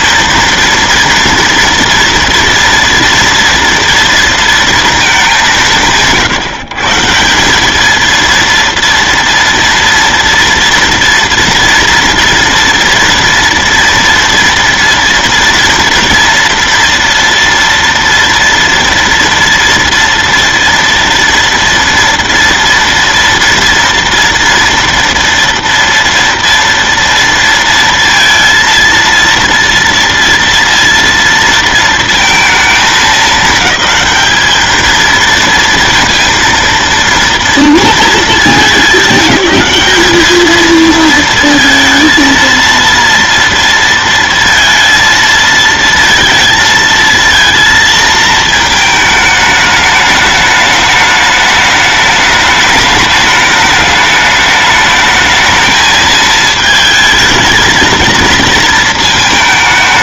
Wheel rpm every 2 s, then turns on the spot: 230, 230, 230, 150, 230, 230, 240, 230, 240, 230, 230, 230, 230, 230, 230, 230, 220, 220, 230, 200, 220, 230, 230, 230, 220, 210, 210, 210, 220, 230.
none